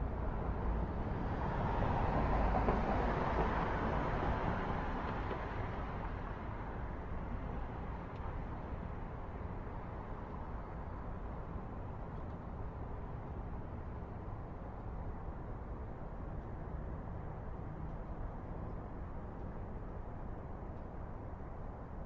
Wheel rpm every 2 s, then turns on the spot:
0, 0, 0, 0, 0, 0, 0, 0, 0, 0, 0.
none